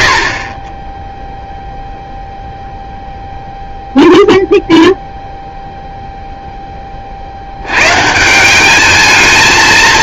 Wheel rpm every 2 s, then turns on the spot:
20, 0, 0, 10, 200.
none